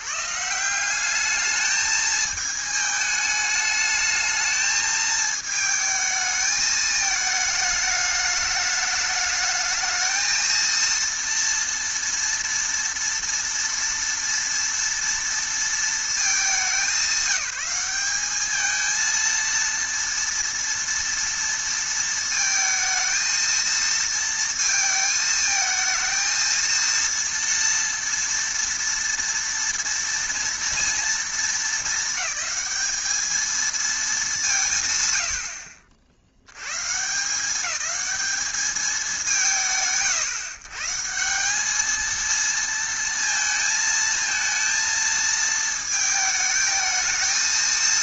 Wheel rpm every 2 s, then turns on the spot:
170, 220, 220, 220, 210, 230, 230, 230, 200, 220, 240, 230, 230, 230, 230, 230, 220, 150, 120, 210, 130, 230, 230, 220.
none